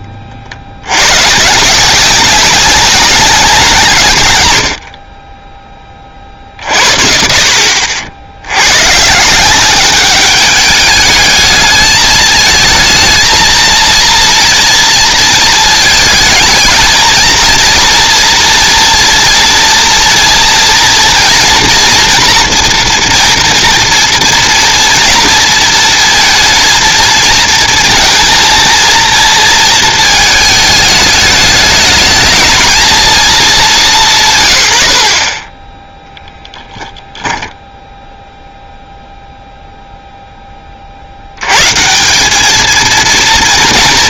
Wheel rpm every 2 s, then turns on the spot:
40, 190, 70, 50, 110, 200, 220, 230, 220, 230, 230, 230, 230, 230, 230, 220, 220, 130, 10, 0, 20, 210.
none